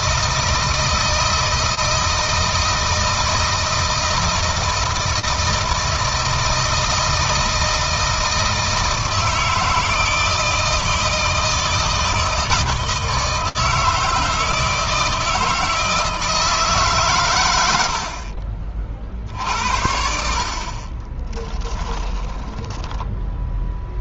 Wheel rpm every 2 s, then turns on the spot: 160, 160, 160, 160, 160, 160, 160, 160, 150, 50, 40, 10.
20-22